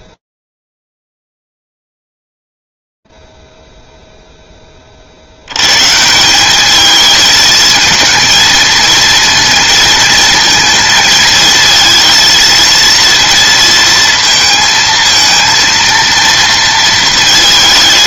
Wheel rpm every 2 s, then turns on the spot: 0, 0, 0, 170, 220, 230, 230, 230, 230.
none